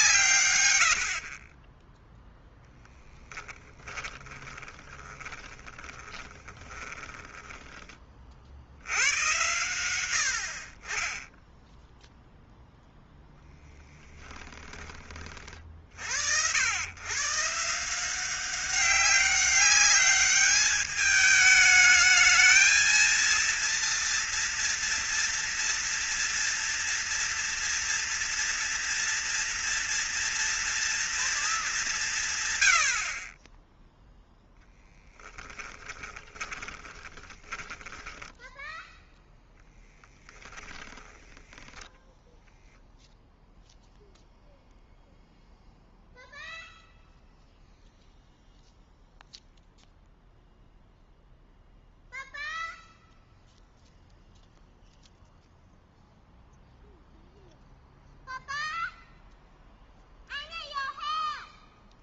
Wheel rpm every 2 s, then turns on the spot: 80, 0, 20, 20, 80, 40, 0, 20, 110, 190, 210, 230, 230, 230, 230, 240, 90, 10, 20, 10, 10, 0, 0, 0, 0, 0, 0, 0, 0, 0, 0.
4-8 34-38